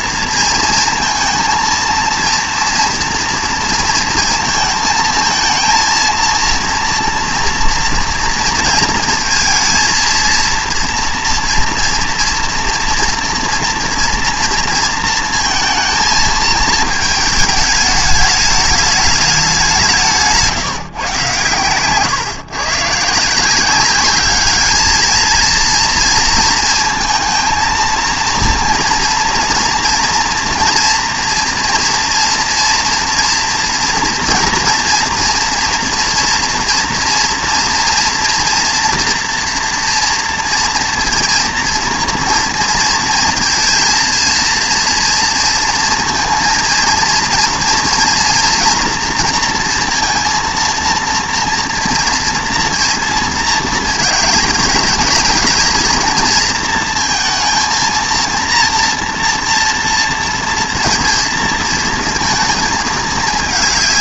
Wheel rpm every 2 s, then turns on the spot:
230, 230, 220, 230, 230, 230, 230, 230, 220, 210, 170, 130, 210, 230, 230, 230, 230, 230, 240, 230, 230, 230, 230, 230, 240, 230, 230, 210, 230, 230, 230, 220.
none